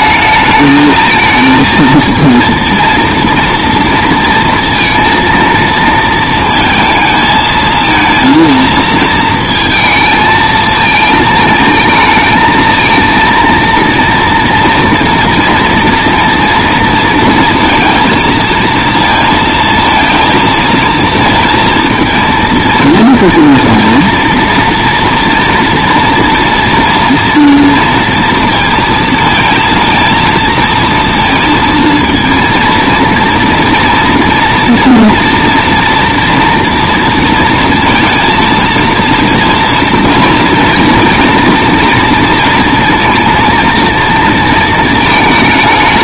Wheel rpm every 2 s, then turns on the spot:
220, 230, 230, 230, 230, 220, 220, 230, 240, 230, 230, 230, 230, 230, 230, 230, 230, 230, 230, 230, 230, 230, 230.
none